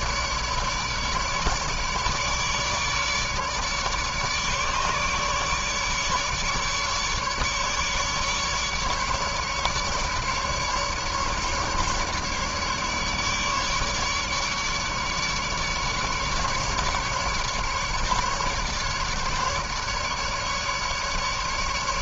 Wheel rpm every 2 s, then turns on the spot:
150, 150, 150, 150, 150, 150, 150, 150, 150, 150, 150.
none